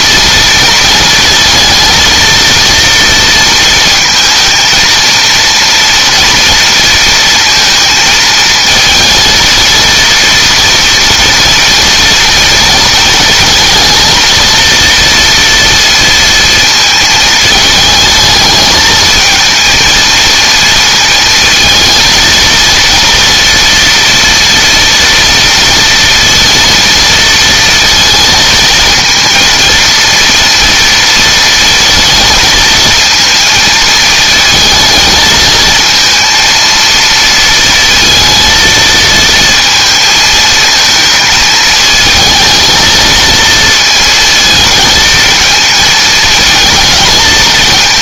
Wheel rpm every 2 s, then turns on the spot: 230, 230, 230, 230, 230, 230, 230, 230, 230, 220, 230, 230, 230, 230, 230, 230, 230, 220, 230, 230, 220, 220, 220, 220.
none